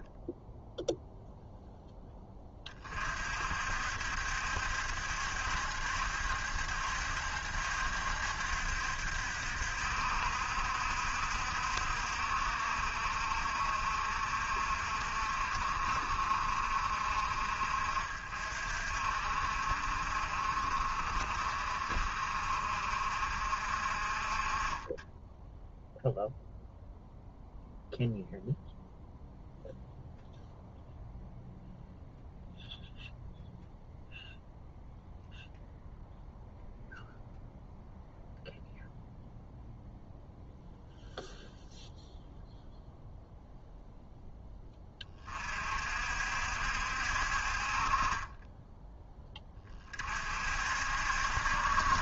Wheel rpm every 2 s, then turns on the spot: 0, 30, 70, 70, 70, 60, 60, 50, 50, 50, 50, 50, 30, 0, 0, 0, 0, 0, 0, 0, 0, 0, 20, 60, 20, 60.
none